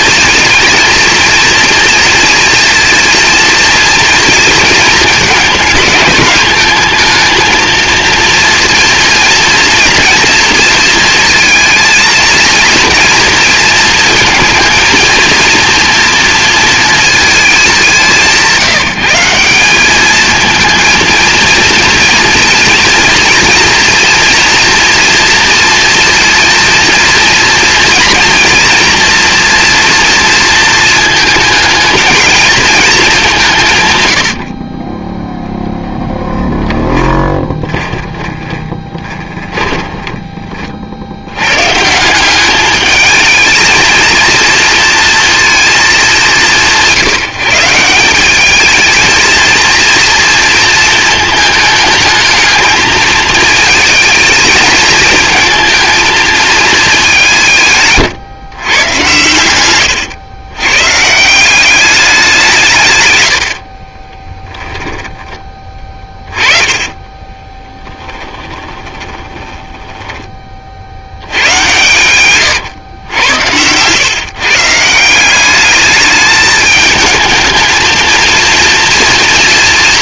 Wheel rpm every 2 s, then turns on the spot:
230, 230, 230, 210, 230, 230, 230, 220, 230, 180, 230, 230, 230, 230, 230, 220, 210, 40, 10, 20, 50, 210, 230, 180, 220, 230, 220, 220, 210, 120, 120, 140, 10, 20, 20, 60, 110, 150, 210, 230.
36-40 64-70